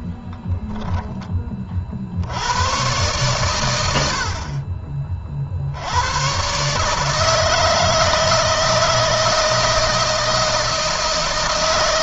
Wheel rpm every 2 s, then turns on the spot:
10, 110, 40, 150, 160, 160.
none